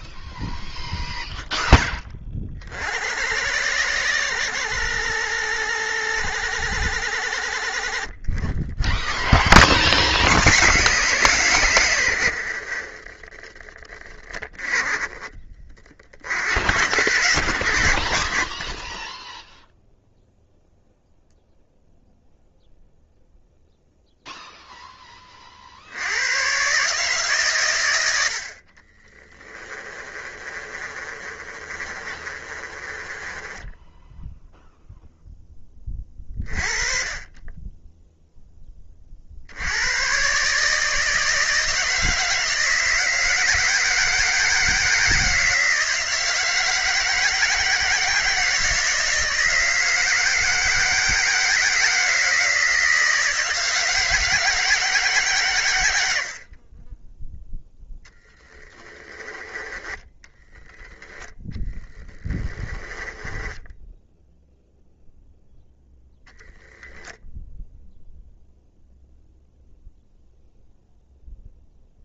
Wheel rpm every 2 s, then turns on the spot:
0, 50, 60, 60, 20, 120, 40, 20, 70, 10, 0, 0, 10, 140, 40, 30, 30, 0, 30, 30, 150, 160, 160, 160, 160, 160, 160, 150, 20, 20, 10, 10, 0, 10, 0, 0.
28-34 58-60 62-64